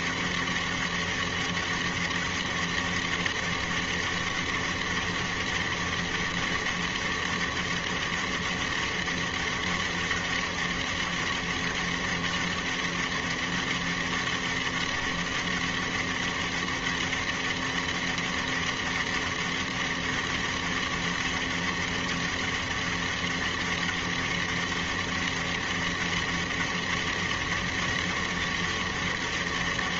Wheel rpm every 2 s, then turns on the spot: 200, 200, 200, 200, 200, 200, 200, 200, 200, 200, 200, 200, 200, 200, 200.
none